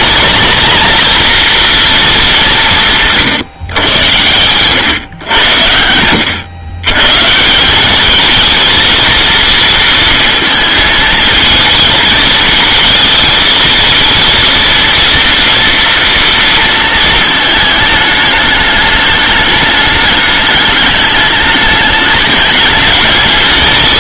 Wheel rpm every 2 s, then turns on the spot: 240, 170, 110, 110, 230, 220, 230, 230, 230, 210, 210, 210.
none